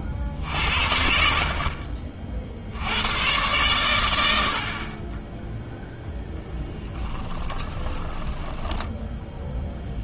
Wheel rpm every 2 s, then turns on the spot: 70, 70, 40, 10, 10.
6-10